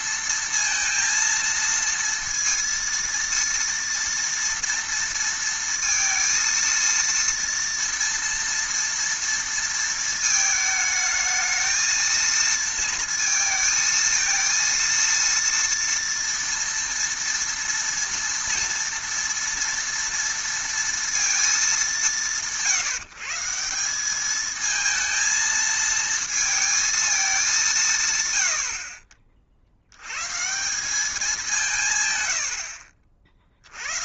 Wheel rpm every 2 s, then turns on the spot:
230, 230, 230, 230, 230, 220, 230, 230, 230, 230, 230, 150, 220, 220, 80, 170, 80.
none